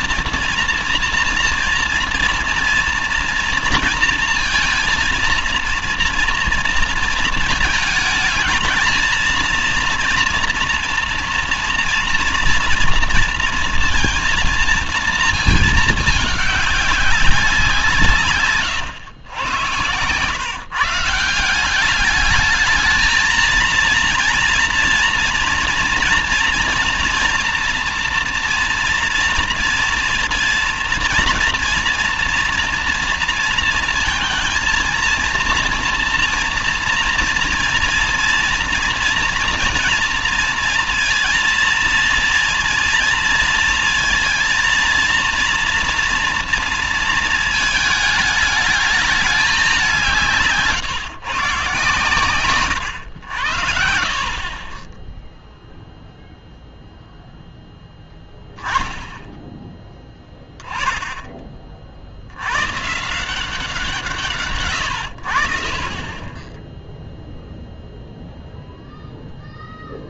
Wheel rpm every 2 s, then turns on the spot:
230, 230, 230, 230, 220, 230, 230, 230, 200, 130, 150, 220, 240, 240, 230, 230, 230, 230, 230, 230, 230, 230, 230, 230, 210, 150, 100, 20, 0, 10, 10, 130, 120, 10, 0.
none